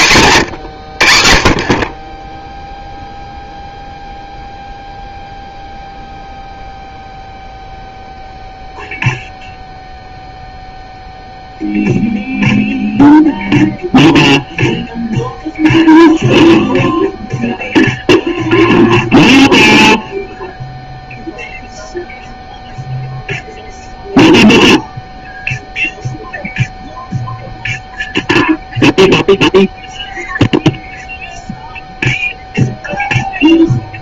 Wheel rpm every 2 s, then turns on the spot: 130, 10, 0, 0, 0, 0, 0, 0, 0, 0, 0, 0, 0, 0, 0, 0, 0.
none